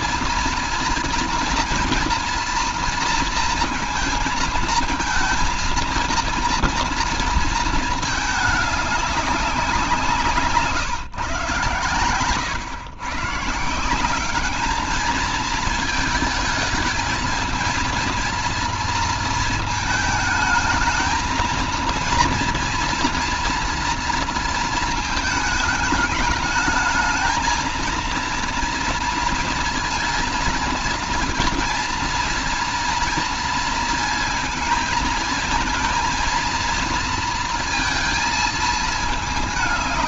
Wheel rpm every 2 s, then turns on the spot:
230, 230, 230, 230, 200, 130, 140, 220, 220, 220, 220, 230, 220, 220, 230, 230, 230, 220, 230, 220.
none